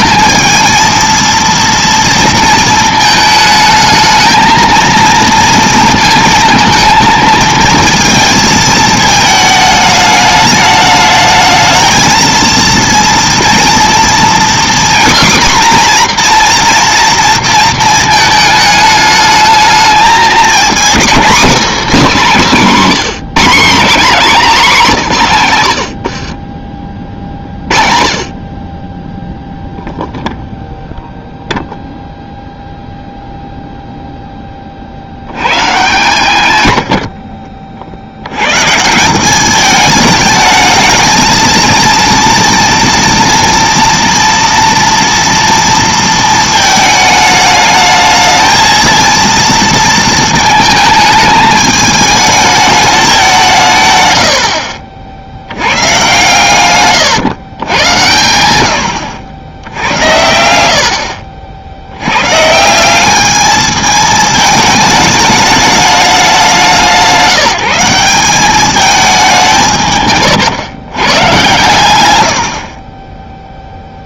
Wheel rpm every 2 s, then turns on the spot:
220, 230, 220, 220, 220, 210, 230, 250, 240, 220, 240, 240, 220, 40, 20, 0, 0, 20, 100, 130, 220, 230, 230, 220, 220, 220, 210, 50, 130, 100, 90, 150, 220, 180, 200, 130, 90.
26-28 56-58